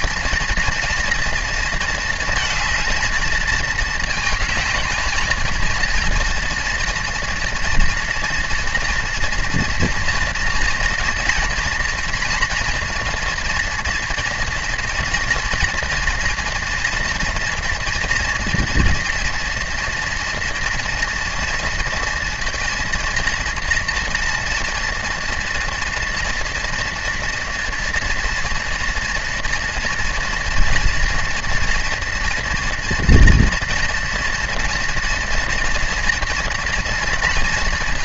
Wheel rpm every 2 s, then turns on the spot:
240, 220, 220, 230, 230, 230, 230, 230, 230, 240, 240, 230, 230, 230, 240, 240, 240, 230, 230.
none